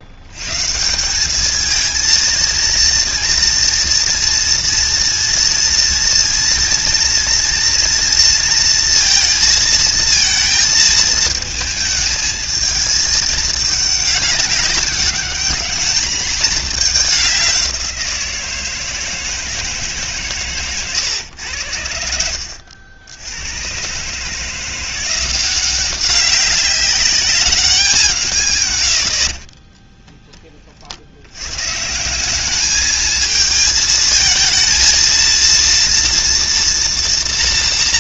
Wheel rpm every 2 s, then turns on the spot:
140, 230, 230, 240, 230, 220, 220, 200, 220, 170, 120, 70, 170, 200, 130, 30, 210, 230, 230.
none